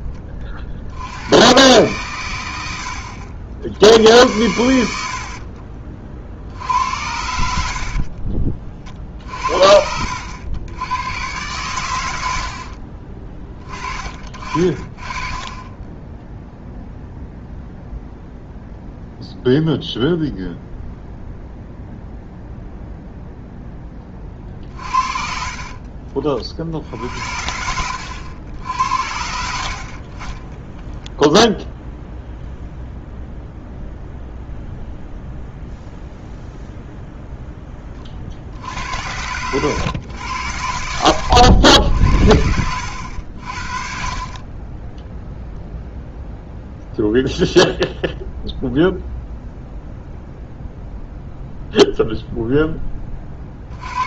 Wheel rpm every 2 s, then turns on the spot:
40, 80, 90, 70, 50, 90, 60, 40, 0, 0, 0, 0, 40, 50, 80, 20, 0, 0, 0, 70, 80, 70, 20, 0, 0, 0, 0.
4-6 12-14 24-26 30-32 42-44